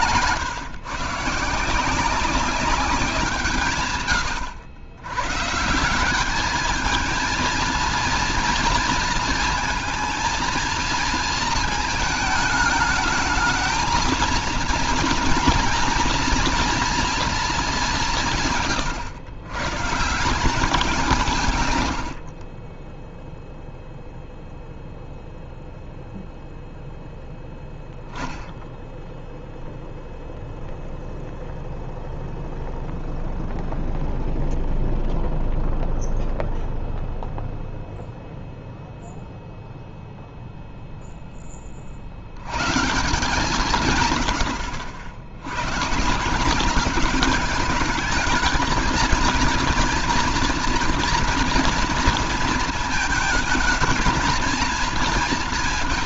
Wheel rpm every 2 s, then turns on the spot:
130, 190, 110, 200, 230, 230, 220, 230, 230, 150, 170, 50, 0, 0, 10, 0, 0, 0, 0, 0, 0, 100, 100, 190, 220, 230, 220, 220.
none